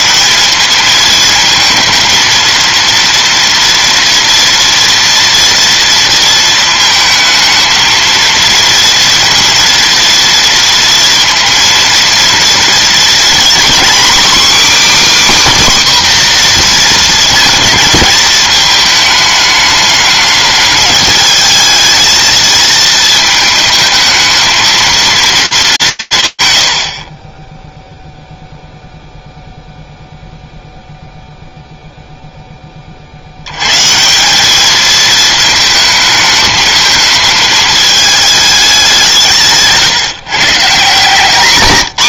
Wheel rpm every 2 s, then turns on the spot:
220, 230, 230, 220, 230, 230, 240, 300, 240, 220, 210, 230, 230, 40, 0, 0, 80, 220, 220, 160, 180.
40-42